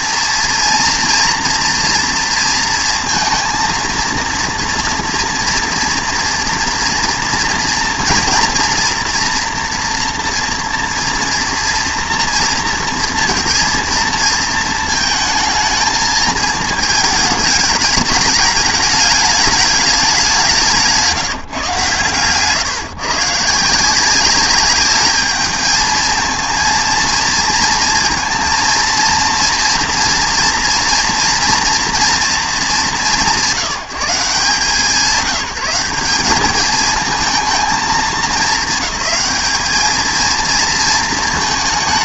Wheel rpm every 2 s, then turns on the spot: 230, 230, 240, 230, 230, 240, 230, 220, 220, 210, 180, 140, 200, 230, 230, 230, 180, 160, 210, 220, 230.
none